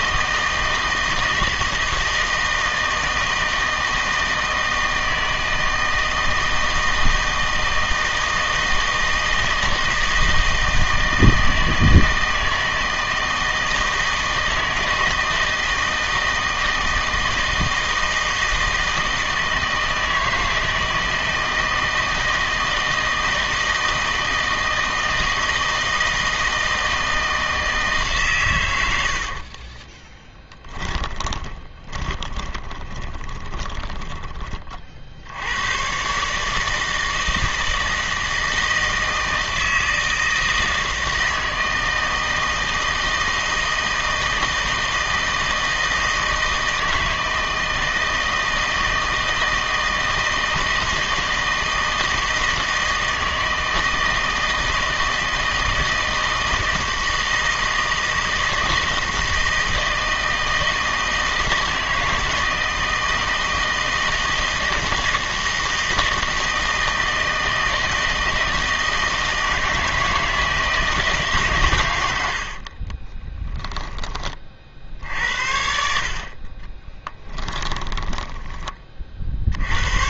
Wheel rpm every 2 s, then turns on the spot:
160, 160, 160, 160, 160, 160, 160, 160, 160, 160, 160, 160, 160, 160, 100, 20, 20, 30, 160, 160, 160, 160, 160, 160, 160, 160, 160, 160, 160, 160, 170, 160, 160, 160, 160, 160, 50, 50, 20, 20.
30-34 72-74 76-78